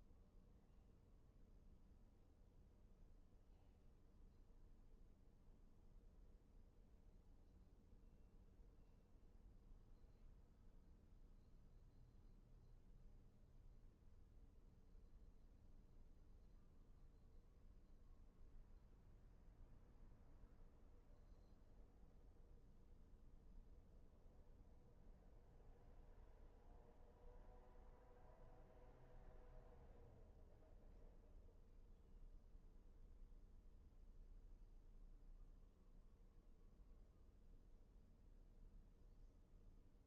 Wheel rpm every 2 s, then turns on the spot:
0, 0, 0, 0, 0, 0, 0, 0, 0, 0, 0, 0, 0, 0, 0, 0, 0, 0, 0, 0.
none